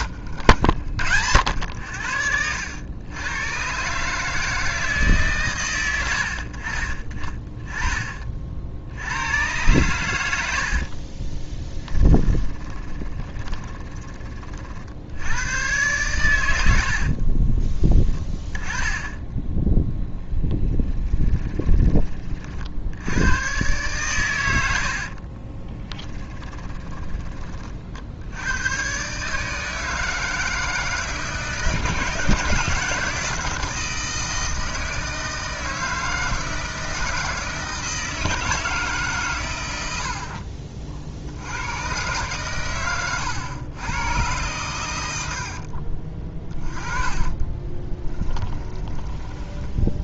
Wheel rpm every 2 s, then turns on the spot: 90, 80, 160, 60, 50, 60, 20, 50, 70, 10, 10, 50, 90, 20, 100, 160, 160, 160, 160, 160, 50, 120, 110, 20, 20.
12-14 16-18 20-22 26-28 46-50